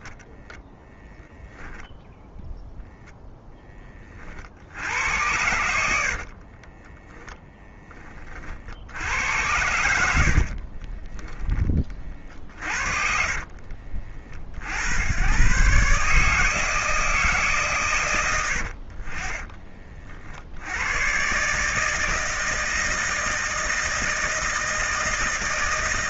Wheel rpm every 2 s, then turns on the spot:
10, 0, 50, 40, 50, 50, 40, 50, 150, 90, 70, 160, 160.
6-8 10-14